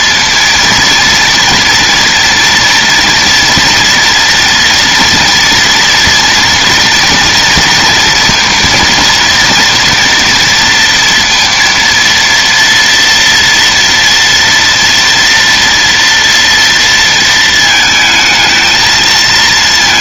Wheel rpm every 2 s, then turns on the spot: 230, 230, 230, 230, 240, 230, 230, 230, 230, 220.
none